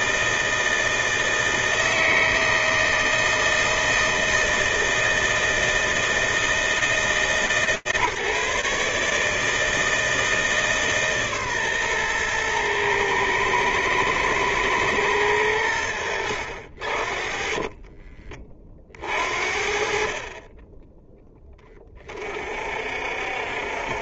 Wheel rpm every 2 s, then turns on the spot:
160, 160, 160, 160, 150, 150, 110, 110, 60, 50, 10, 60.
none